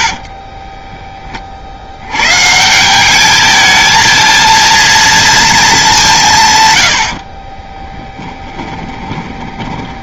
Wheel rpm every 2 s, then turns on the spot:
20, 170, 230, 110, 20.
0-2 8-10